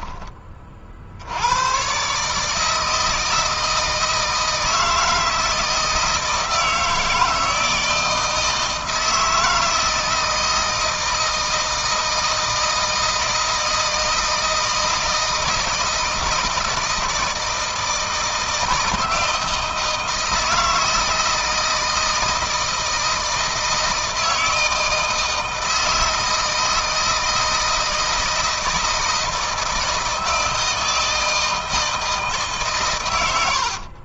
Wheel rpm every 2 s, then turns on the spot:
40, 160, 160, 160, 160, 160, 160, 160, 160, 160, 160, 160, 160, 160, 160, 160, 130.
none